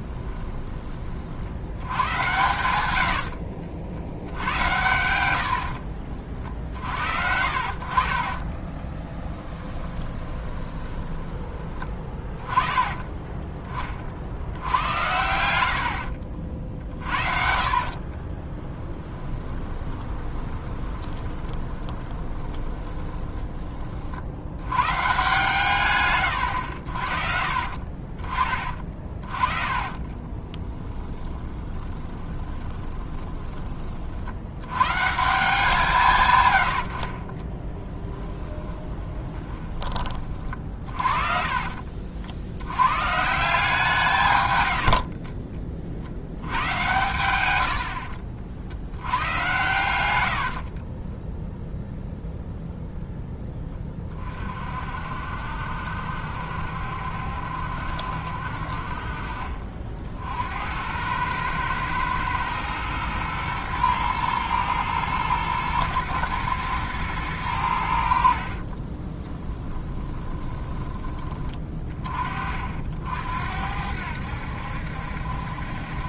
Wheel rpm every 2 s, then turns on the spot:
30, 90, 100, 60, 40, 30, 20, 90, 50, 20, 20, 30, 110, 60, 30, 20, 20, 120, 60, 10, 40, 110, 90, 100, 80, 50, 0, 50, 70, 50, 80, 110, 110, 110, 30, 20, 60, 70.
2-4 8-12 14-16 18-24 28-34 36-42 50-52 68-72